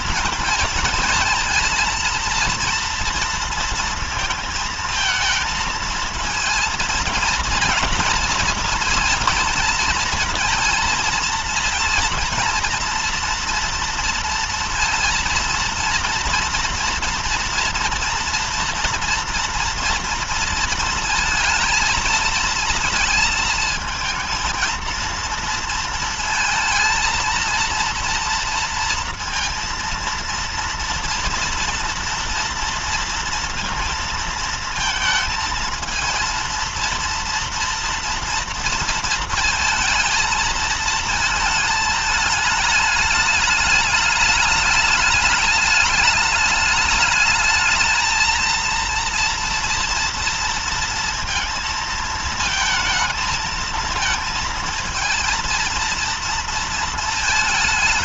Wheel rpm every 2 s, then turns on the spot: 230, 230, 230, 220, 230, 230, 230, 230, 230, 230, 230, 220, 230, 230, 230, 230, 230, 230, 230, 230, 220, 210, 210, 210, 230, 230, 220, 220, 230.
none